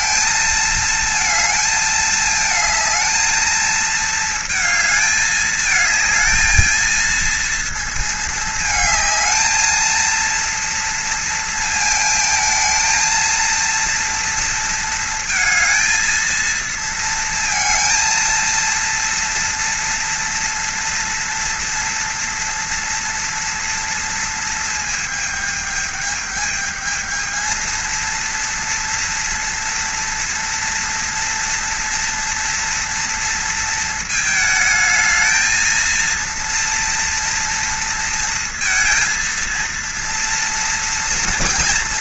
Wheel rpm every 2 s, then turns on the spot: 230, 220, 220, 220, 220, 230, 220, 230, 220, 230, 230, 230, 220, 220, 230, 230, 240, 220, 230, 230, 230.
none